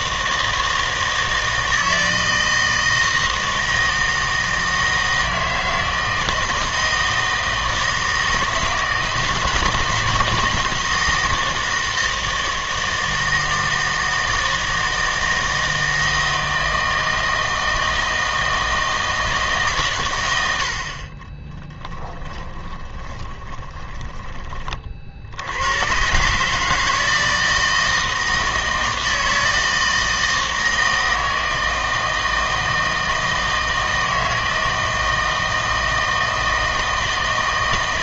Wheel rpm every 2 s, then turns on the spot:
160, 160, 160, 160, 160, 160, 160, 160, 160, 160, 70, 30, 30, 150, 160, 160, 160, 160, 160.
22-24